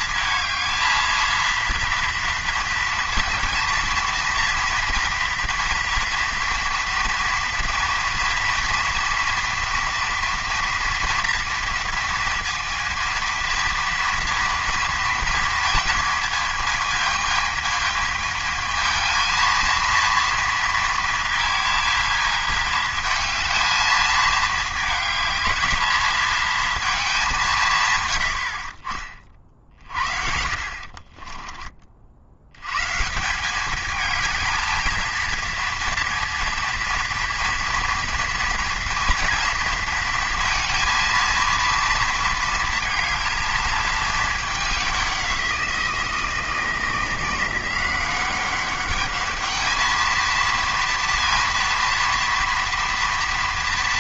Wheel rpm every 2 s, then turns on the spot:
220, 230, 240, 240, 230, 230, 230, 230, 220, 220, 230, 220, 220, 220, 40, 50, 130, 220, 230, 230, 230, 230, 200, 170, 200, 230, 230.
30-32